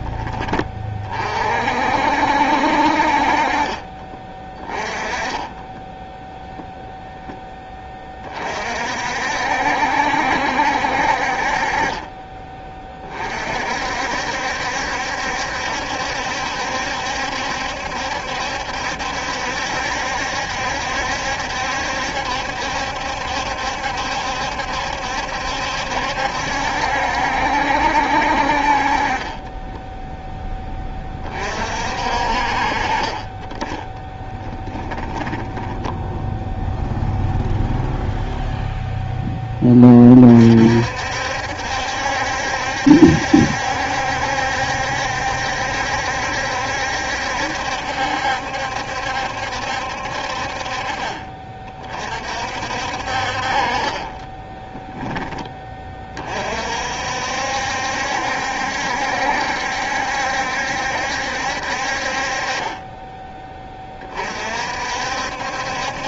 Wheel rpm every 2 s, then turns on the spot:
30, 60, 20, 0, 50, 60, 20, 70, 70, 70, 70, 70, 70, 70, 40, 20, 40, 10, 0, 0, 60, 70, 70, 70, 70, 40, 60, 10, 50, 70, 70, 20, 50.
4-6 34-36 54-56